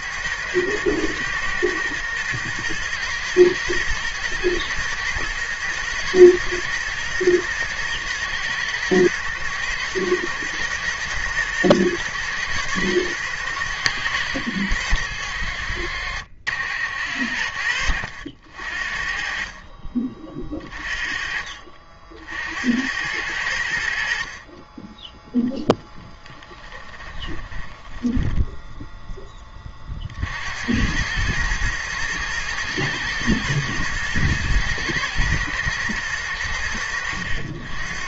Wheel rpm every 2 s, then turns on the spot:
100, 120, 110, 110, 110, 120, 110, 80, 80, 50, 30, 80, 20, 20, 10, 90, 110, 110, 90.
26-28